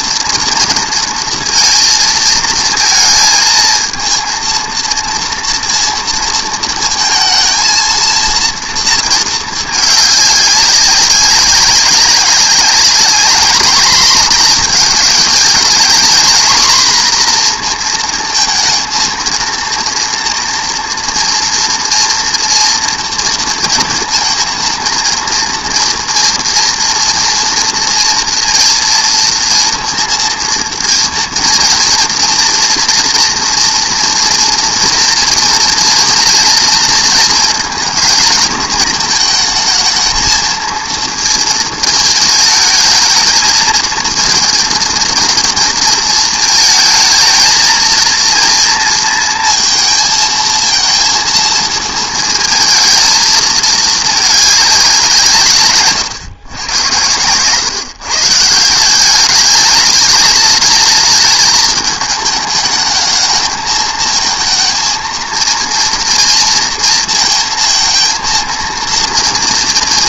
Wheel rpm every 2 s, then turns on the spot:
230, 230, 230, 230, 230, 200, 200, 220, 240, 230, 230, 240, 230, 230, 230, 230, 230, 230, 230, 220, 230, 220, 230, 220, 230, 220, 220, 200, 100, 160, 210, 210, 230, 230, 230.
none